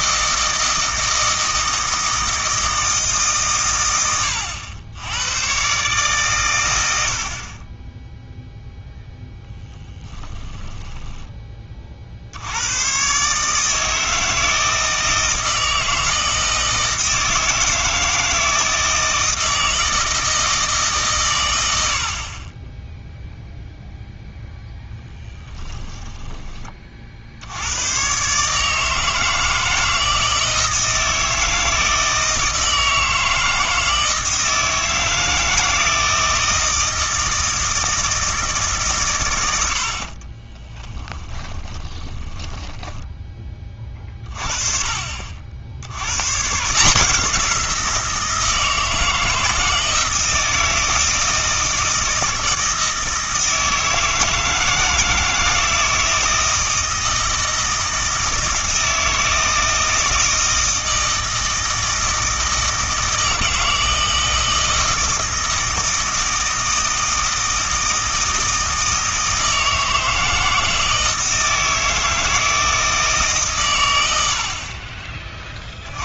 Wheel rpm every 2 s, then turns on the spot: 160, 160, 90, 90, 0, 10, 100, 160, 160, 160, 150, 10, 0, 30, 150, 160, 160, 160, 160, 150, 20, 10, 40, 150, 160, 160, 160, 160, 160, 160, 160, 160, 160, 160, 160, 160, 160, 40.
10-12 40-44